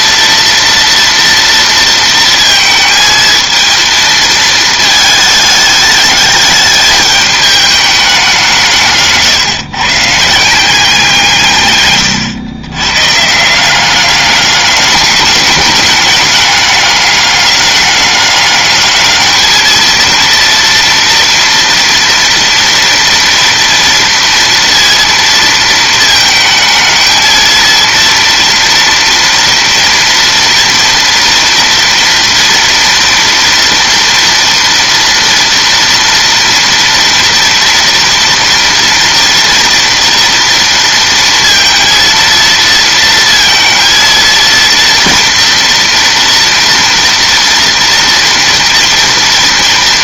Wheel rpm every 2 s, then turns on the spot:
230, 220, 220, 210, 170, 170, 100, 200, 210, 210, 230, 240, 230, 220, 240, 230, 230, 230, 230, 240, 230, 230, 230, 230, 230.
none